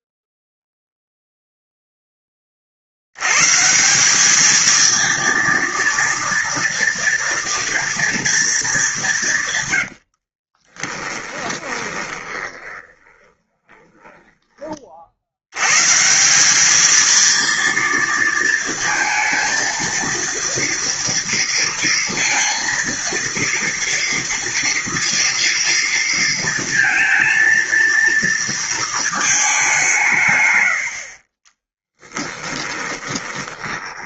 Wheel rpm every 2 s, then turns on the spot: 0, 50, 220, 240, 210, 30, 20, 30, 210, 230, 230, 230, 230, 230, 230, 80, 20.
10-14 32-34